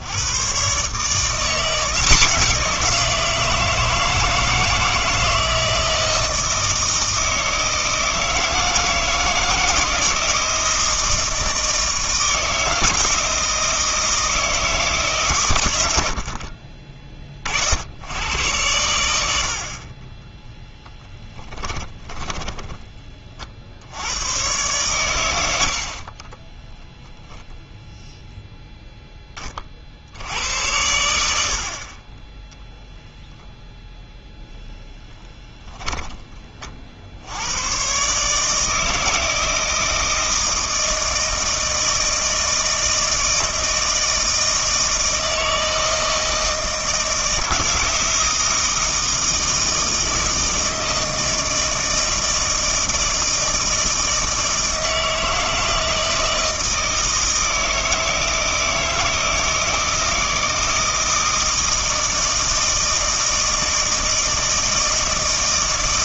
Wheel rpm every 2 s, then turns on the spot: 150, 170, 160, 160, 160, 160, 160, 150, 20, 100, 0, 20, 110, 0, 0, 80, 10, 10, 50, 160, 160, 160, 160, 160, 160, 160, 160, 160, 160, 160, 160, 160, 160.
none